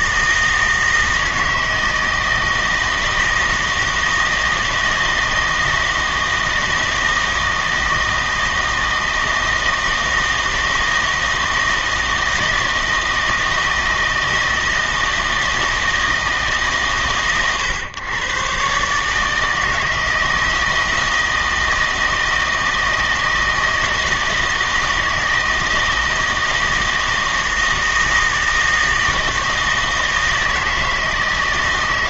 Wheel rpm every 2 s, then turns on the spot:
160, 160, 160, 160, 160, 160, 160, 160, 140, 130, 160, 160, 160, 160, 160, 160.
none